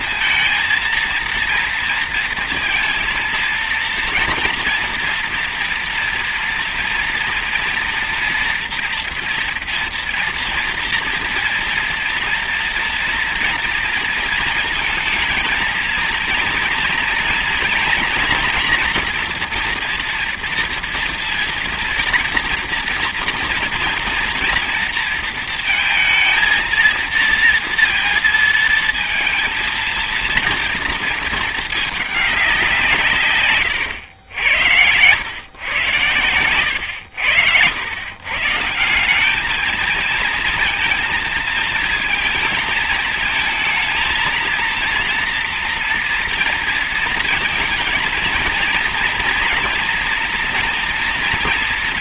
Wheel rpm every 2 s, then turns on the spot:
230, 230, 240, 230, 230, 230, 230, 220, 230, 240, 230, 240, 230, 230, 220, 220, 160, 100, 100, 180, 230, 220, 230, 230, 230, 230.
none